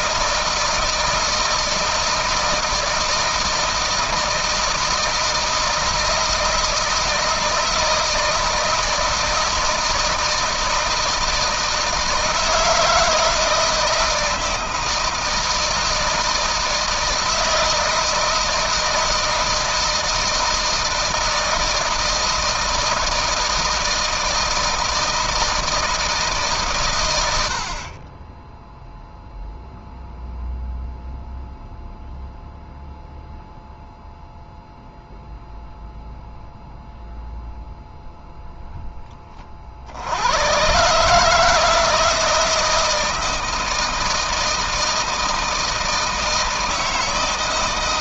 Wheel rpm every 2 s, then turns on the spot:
160, 160, 160, 160, 160, 160, 160, 160, 160, 160, 160, 160, 160, 150, 20, 0, 0, 0, 0, 0, 100, 160, 160, 160.
none